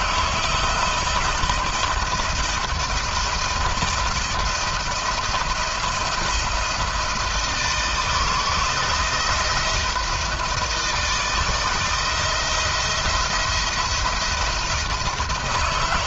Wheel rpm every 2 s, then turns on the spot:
160, 170, 170, 170, 170, 160, 170, 170.
none